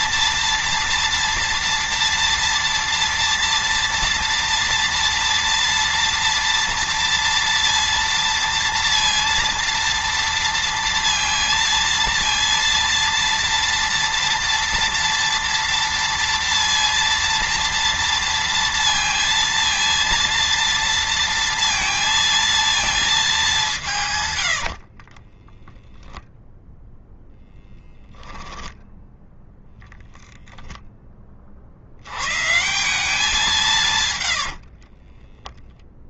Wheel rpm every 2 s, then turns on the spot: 230, 230, 230, 230, 230, 230, 230, 230, 230, 230, 230, 230, 60, 0, 10, 10, 170, 60.
24-26 34-36